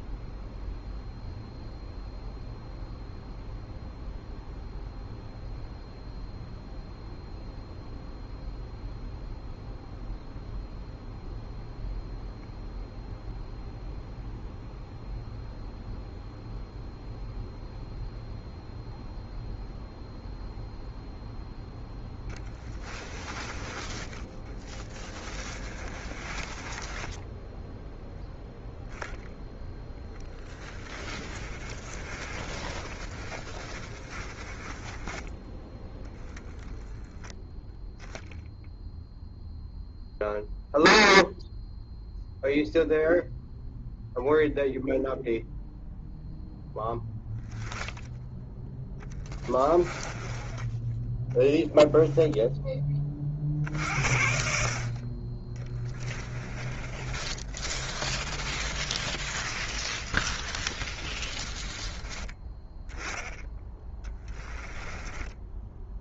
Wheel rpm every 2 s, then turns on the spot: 0, 0, 0, 0, 0, 0, 0, 0, 0, 0, 0, 10, 20, 20, 0, 20, 30, 20, 0, 0, 0, 0, 0, 0, 10, 10, 20, 50, 30, 30, 30, 10, 10.
22-28 30-36 56-62 64-66